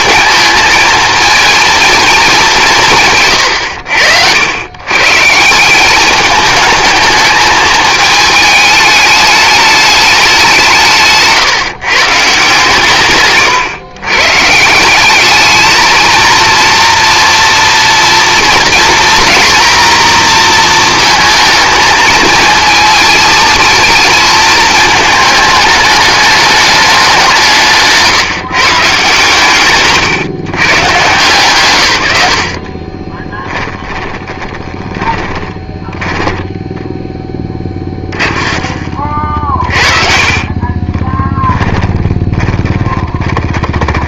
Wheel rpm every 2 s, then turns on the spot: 220, 190, 110, 220, 210, 170, 150, 160, 230, 230, 230, 230, 220, 210, 140, 130, 50, 20, 10, 40, 30, 20.
32-36 38-44